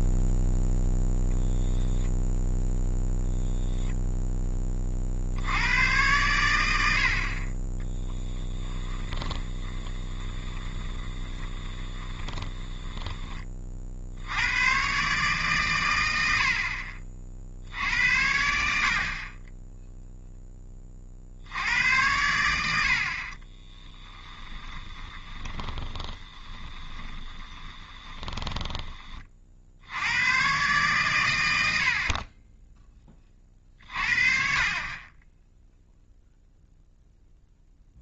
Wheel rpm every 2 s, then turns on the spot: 0, 10, 10, 100, 10, 20, 20, 100, 60, 70, 10, 80, 20, 20, 10, 120, 20, 40, 0.
2-4 8-14 24-30